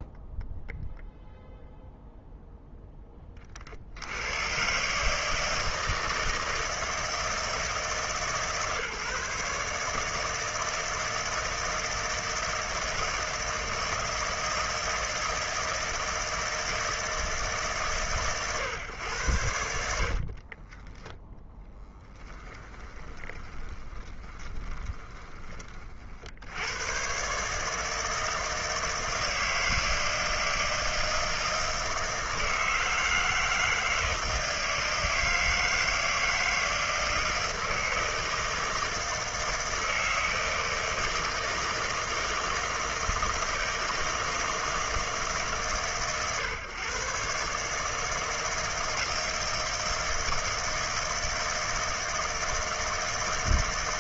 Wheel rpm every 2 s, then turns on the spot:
0, 0, 120, 160, 150, 160, 160, 160, 160, 120, 20, 10, 20, 90, 160, 160, 160, 160, 160, 160, 160, 160, 160, 120, 160, 160, 160.
20-26